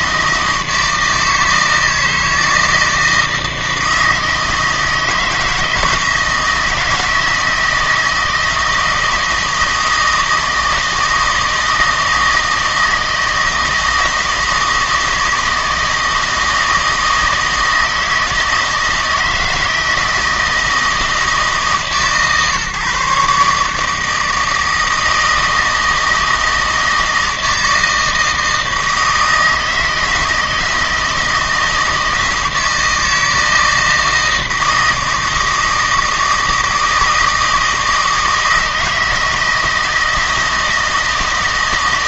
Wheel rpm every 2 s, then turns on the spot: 160, 160, 160, 160, 160, 160, 160, 160, 160, 160, 160, 140, 160, 160, 160, 160, 160, 160, 160, 160, 160.
none